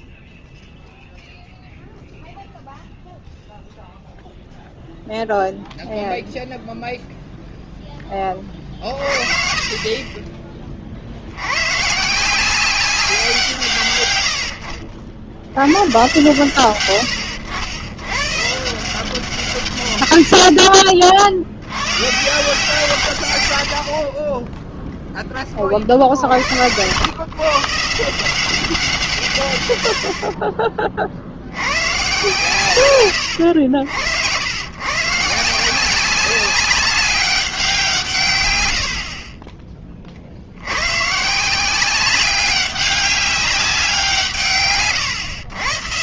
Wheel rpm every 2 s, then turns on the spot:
0, 0, 0, 30, 20, 180, 70, 120, 140, 50, 150, 10, 60, 170, 70, 120, 80, 190, 160, 30, 190, 180, 130.
22-24